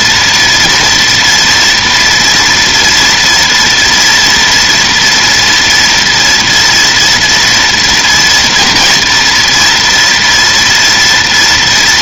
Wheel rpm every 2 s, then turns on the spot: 230, 230, 230, 230, 240, 240.
none